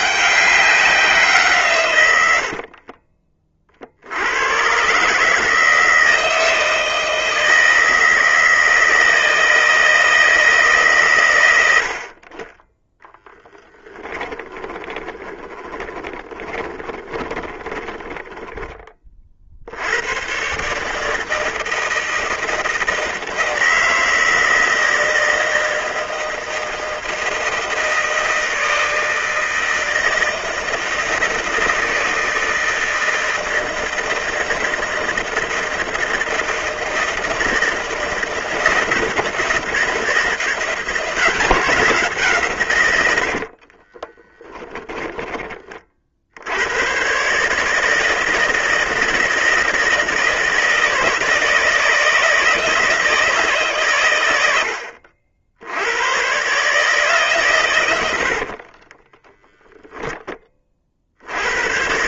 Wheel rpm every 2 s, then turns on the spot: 190, 50, 120, 160, 160, 140, 10, 20, 20, 20, 140, 160, 160, 160, 160, 160, 160, 160, 160, 170, 170, 120, 10, 100, 160, 160, 160, 80, 140, 40, 30.
2-4 14-18 44-46 58-60